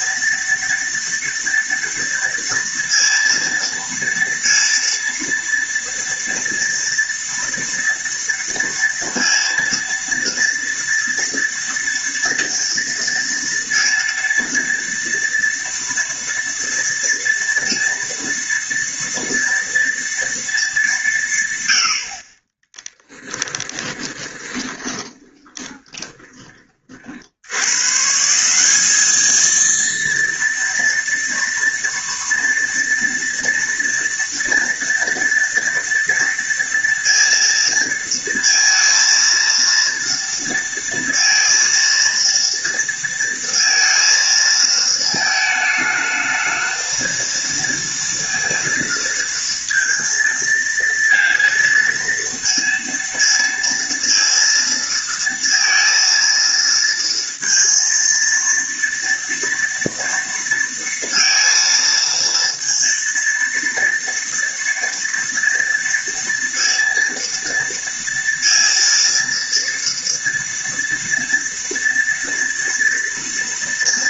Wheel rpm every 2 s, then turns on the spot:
230, 230, 230, 240, 230, 230, 230, 230, 230, 230, 210, 20, 20, 30, 190, 230, 230, 240, 230, 230, 230, 230, 230, 220, 230, 230, 230, 230, 230, 230, 230, 230, 230, 230, 230, 230, 230.
22-26